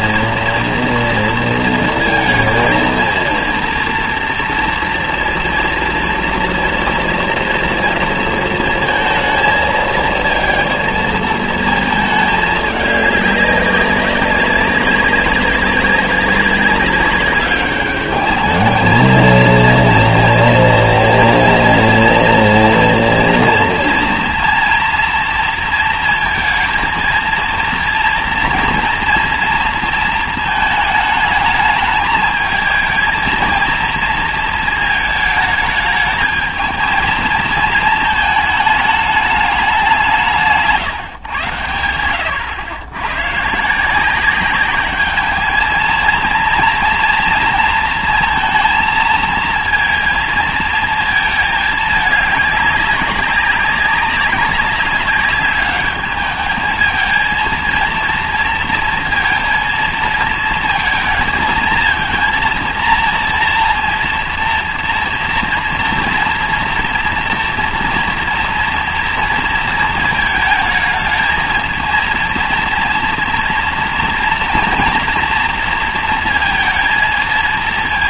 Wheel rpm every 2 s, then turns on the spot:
230, 230, 230, 230, 230, 230, 210, 190, 200, 220, 230, 230, 230, 230, 230, 220, 220, 220, 220, 210, 140, 110, 200, 230, 230, 230, 200, 200, 220, 230, 230, 230, 230, 230, 230, 220, 230, 230, 230.
none